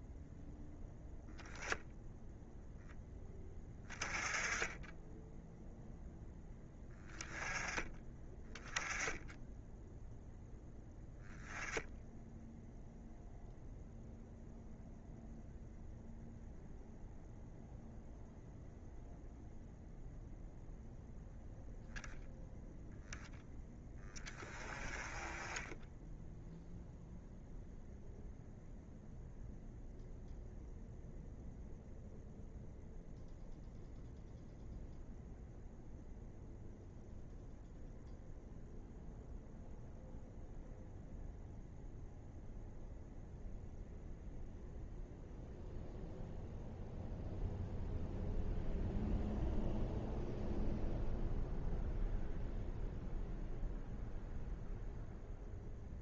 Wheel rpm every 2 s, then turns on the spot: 0, 10, 10, 10, 10, 0, 0, 0, 0, 0, 0, 0, 20, 0, 0, 0, 0, 0, 0, 0, 0, 0, 0, 0, 0, 0, 0, 0.
none